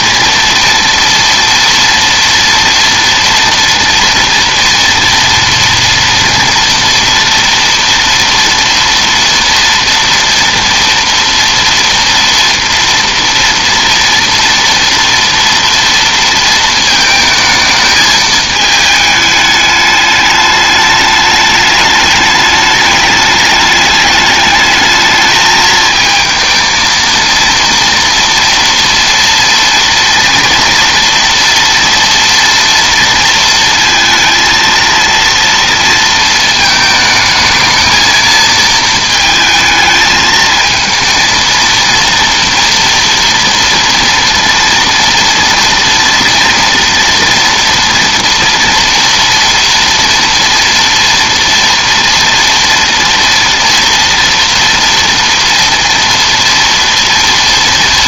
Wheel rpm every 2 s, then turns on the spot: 230, 230, 230, 230, 230, 230, 230, 230, 220, 210, 210, 210, 210, 230, 230, 230, 230, 230, 220, 220, 220, 240, 230, 230, 230, 230, 230, 230, 230.
none